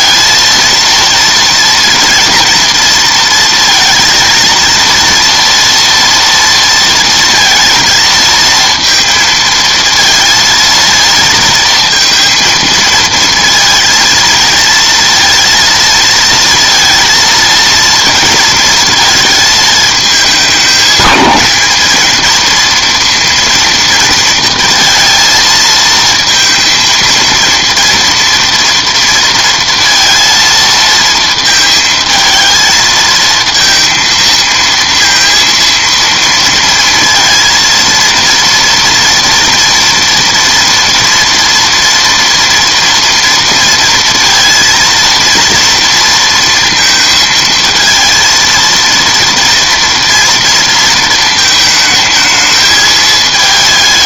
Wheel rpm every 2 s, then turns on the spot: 230, 230, 230, 230, 230, 230, 230, 230, 230, 230, 210, 230, 230, 230, 230, 230, 220, 230, 230, 230, 230, 230, 230, 230, 230, 230, 220.
none